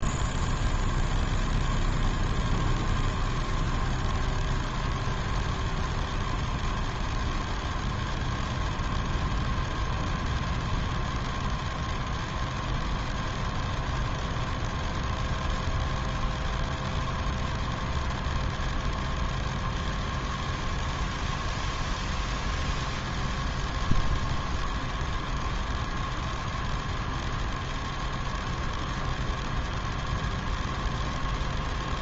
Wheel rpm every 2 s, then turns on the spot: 0, 0, 0, 0, 0, 0, 0, 0, 0, 0, 0, 0, 0, 0, 0, 0.
none